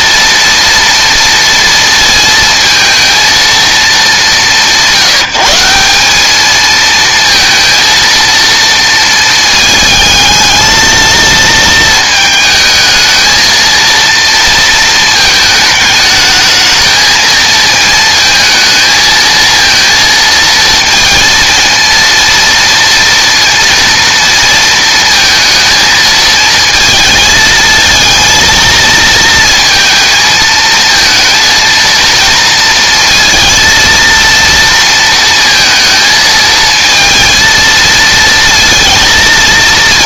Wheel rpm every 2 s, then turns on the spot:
230, 230, 180, 230, 220, 230, 220, 220, 220, 220, 230, 230, 230, 220, 230, 230, 230, 220, 230, 230.
none